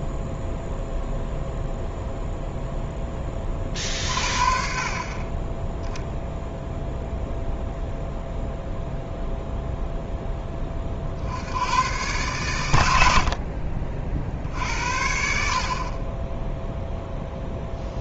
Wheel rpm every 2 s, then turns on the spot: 0, 0, 30, 0, 0, 30, 100, 70, 0.
none